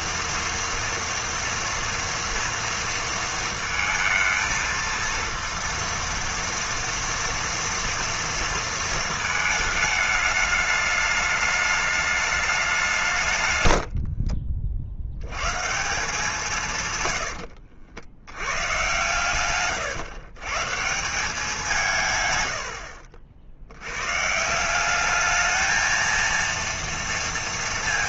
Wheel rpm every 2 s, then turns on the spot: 230, 230, 230, 230, 230, 210, 160, 70, 110, 120, 160, 70, 200, 230.
16-18